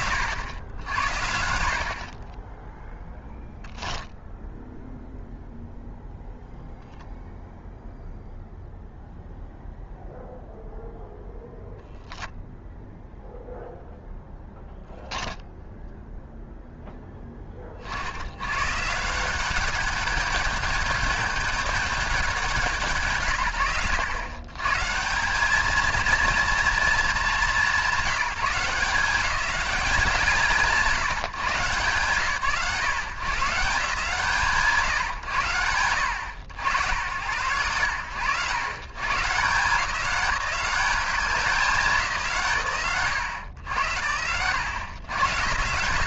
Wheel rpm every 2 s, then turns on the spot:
80, 0, 0, 0, 0, 0, 0, 0, 10, 140, 210, 140, 170, 220, 180, 150, 130, 140, 70, 120, 200, 100, 110.
none